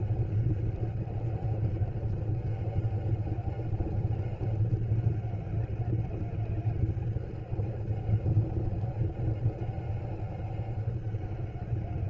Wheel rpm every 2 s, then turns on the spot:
200, 200, 190, 200, 200, 200.
none